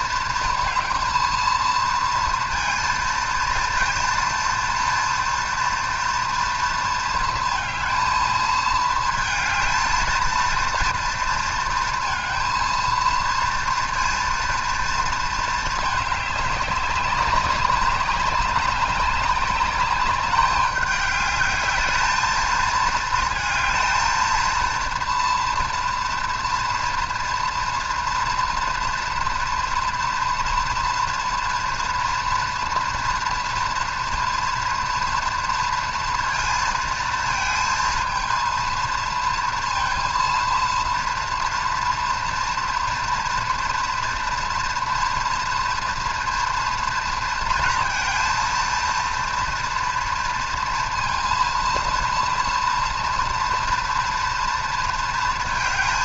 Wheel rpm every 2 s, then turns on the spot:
230, 230, 230, 230, 220, 230, 230, 230, 200, 200, 210, 220, 230, 240, 230, 230, 230, 230, 230, 230, 230, 230, 230, 230, 230, 230, 230, 230.
none